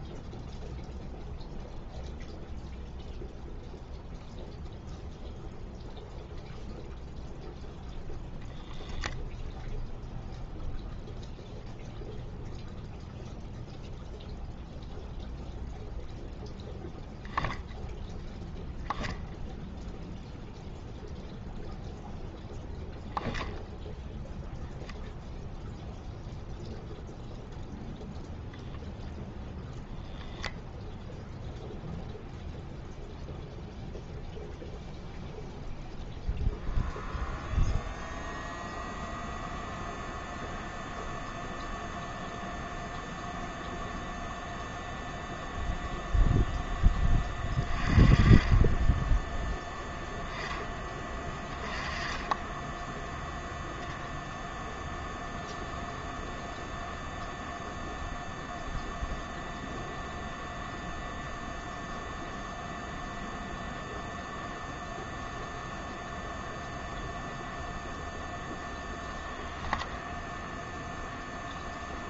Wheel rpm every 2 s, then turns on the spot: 0, 0, 0, 0, 0, 0, 0, 0, 0, 0, 0, 0, 0, 0, 0, 0, 0, 0, 0, 0, 0, 0, 0, 10, 10, 20, 10, 0, 0, 0, 0, 0, 0, 0, 0, 0.
none